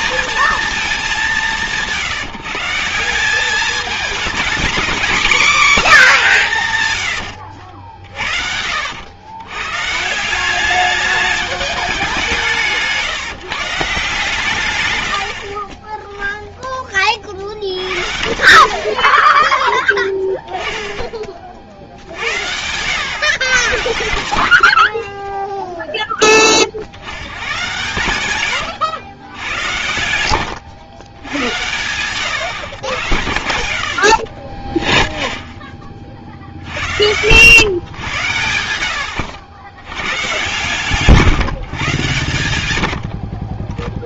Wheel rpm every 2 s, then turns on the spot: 230, 160, 240, 170, 70, 200, 170, 120, 10, 50, 10, 90, 60, 40, 110, 80, 120, 20, 70, 90, 140, 100.
30-32 36-38